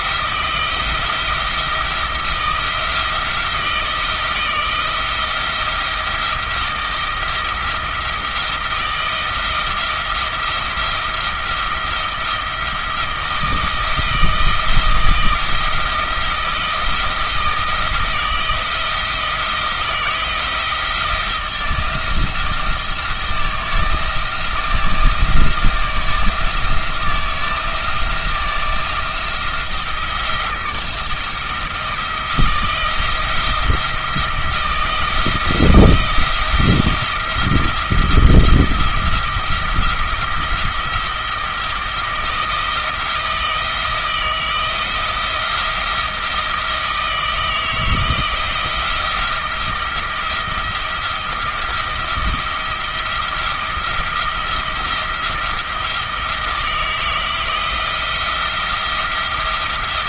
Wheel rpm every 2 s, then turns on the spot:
170, 170, 160, 170, 160, 170, 160, 160, 160, 160, 170, 170, 160, 160, 170, 170, 170, 170, 170, 170, 170, 170, 170, 160, 170, 170, 170, 170, 160, 170.
none